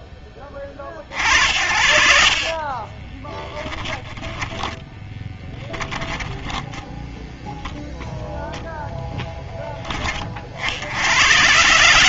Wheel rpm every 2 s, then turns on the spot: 50, 20, 10, 10, 0, 80.
2-4